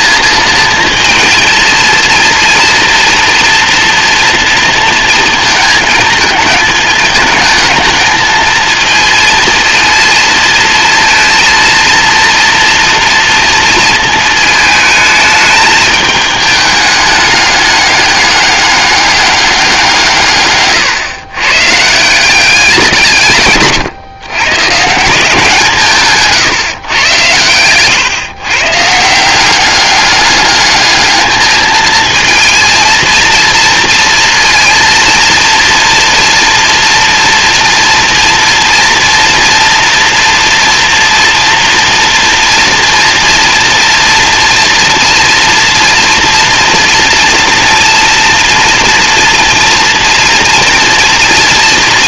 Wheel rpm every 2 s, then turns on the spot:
230, 230, 220, 220, 230, 230, 230, 220, 210, 200, 140, 170, 170, 130, 160, 210, 230, 230, 230, 230, 230, 230, 230, 230, 230, 230.
none